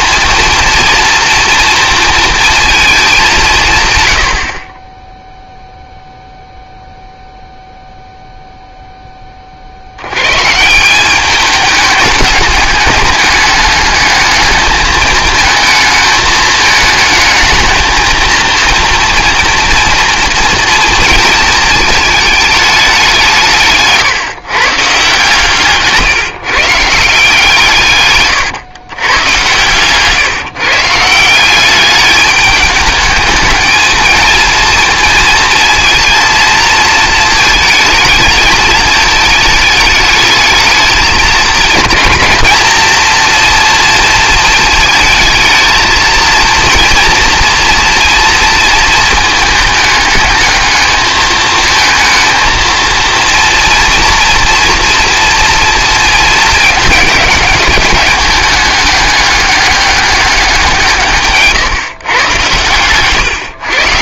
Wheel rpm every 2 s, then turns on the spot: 240, 230, 30, 0, 0, 160, 210, 210, 220, 230, 230, 210, 150, 160, 120, 150, 210, 230, 230, 220, 210, 230, 220, 230, 230, 220, 230, 230, 220, 200, 170, 120.
62-64